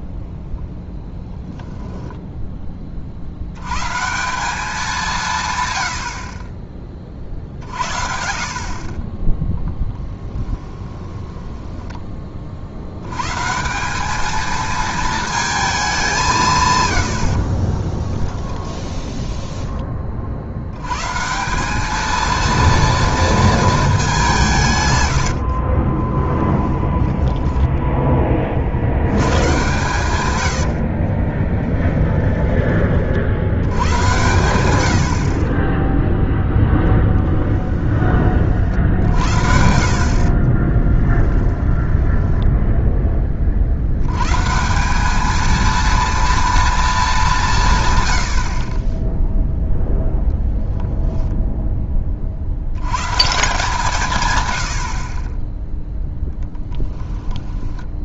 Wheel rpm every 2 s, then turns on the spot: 0, 20, 190, 30, 50, 20, 60, 220, 130, 10, 90, 230, 140, 10, 50, 60, 20, 100, 0, 50, 30, 0, 170, 230, 40, 0, 90, 90, 10.
10-12 18-20 26-28 30-32 40-42 56-58